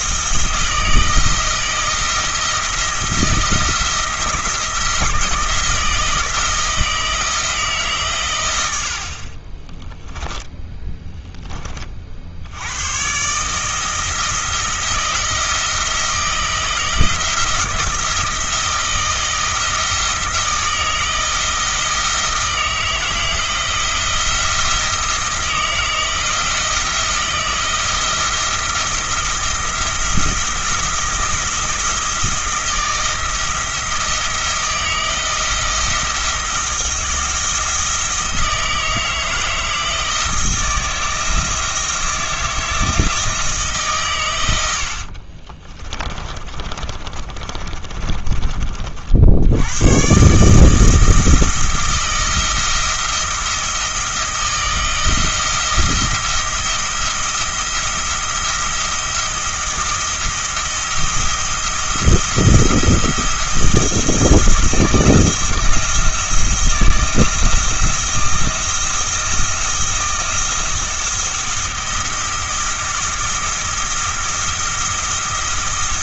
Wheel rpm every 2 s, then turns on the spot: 170, 170, 160, 160, 90, 10, 100, 170, 160, 160, 160, 160, 170, 160, 160, 160, 170, 160, 170, 160, 170, 160, 80, 30, 40, 160, 170, 160, 170, 170, 170, 170, 170, 170, 170, 170, 170, 170.
10-12 44-48